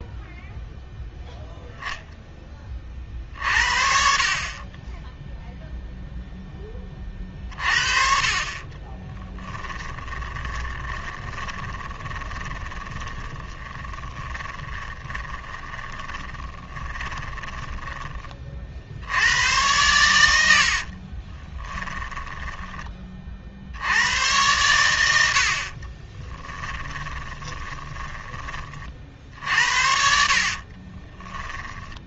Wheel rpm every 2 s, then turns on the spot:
0, 20, 30, 10, 40, 20, 20, 20, 20, 40, 80, 10, 100, 20, 30, 40.
8-18 20-24 26-28 30-32